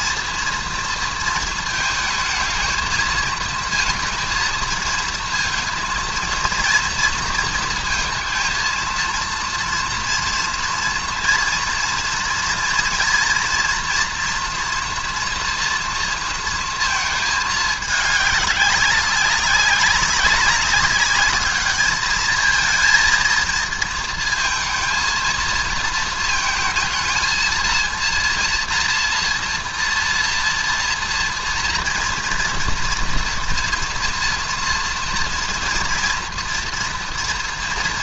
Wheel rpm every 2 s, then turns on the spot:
230, 220, 230, 230, 230, 230, 230, 230, 230, 200, 200, 210, 230, 230, 230, 230, 230, 240, 230.
none